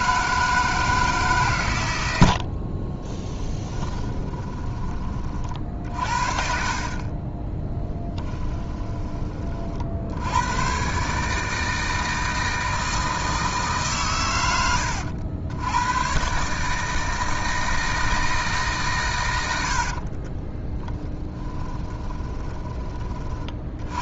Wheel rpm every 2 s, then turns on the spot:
160, 40, 20, 40, 10, 120, 160, 90, 160, 140, 10, 30.
2-4 8-10 20-22